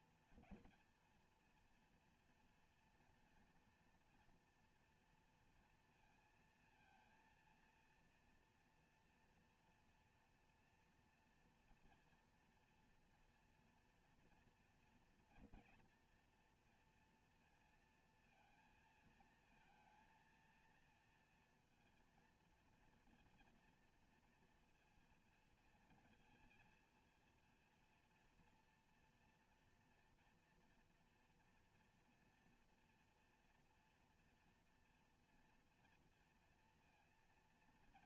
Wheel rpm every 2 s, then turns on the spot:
230, 230, 230, 230, 230, 230, 230, 230, 230, 230, 230, 240, 230, 230, 240, 240, 230, 230, 230.
none